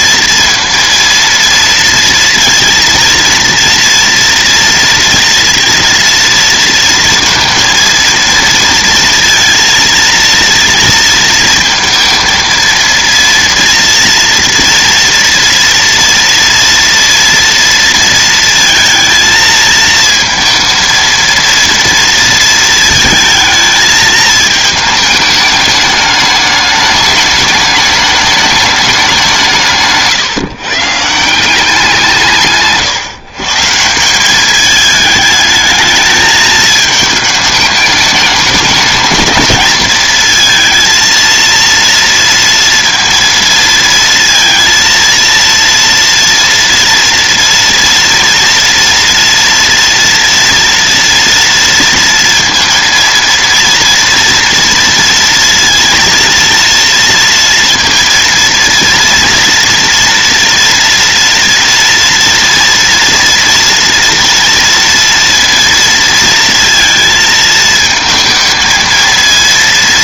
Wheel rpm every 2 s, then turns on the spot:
230, 230, 240, 230, 230, 230, 230, 230, 230, 230, 230, 230, 220, 210, 210, 140, 140, 200, 220, 210, 220, 230, 230, 240, 230, 230, 230, 230, 230, 230, 230, 230, 230, 230, 220.
none